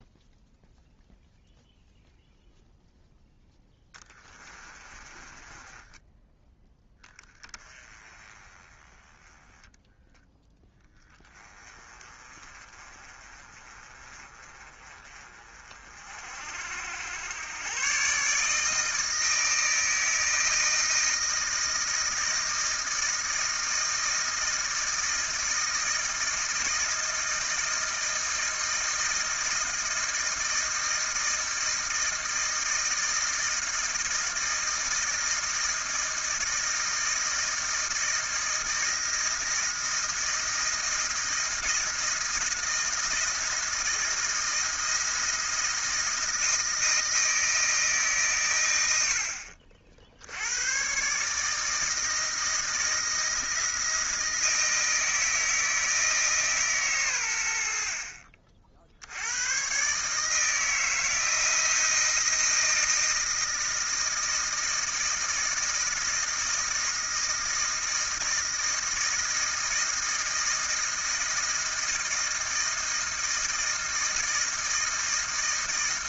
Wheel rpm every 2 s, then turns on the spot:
0, 0, 30, 20, 10, 10, 30, 40, 80, 160, 160, 160, 160, 160, 160, 160, 160, 160, 160, 160, 170, 170, 160, 160, 90, 110, 160, 160, 130, 60, 160, 160, 160, 160, 160, 160, 160, 160.
4-6